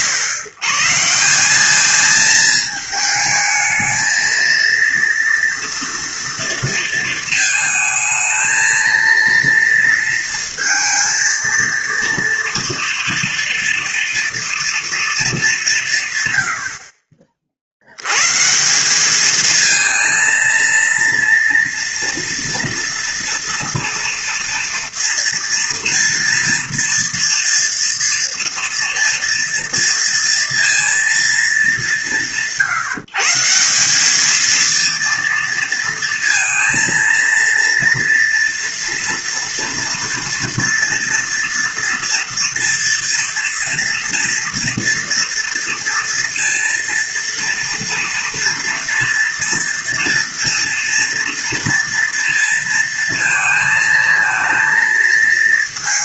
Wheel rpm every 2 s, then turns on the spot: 120, 220, 230, 230, 230, 230, 230, 230, 80, 160, 230, 230, 230, 230, 230, 230, 140, 230, 230, 230, 230, 230, 230, 230, 230, 230, 230, 230.
none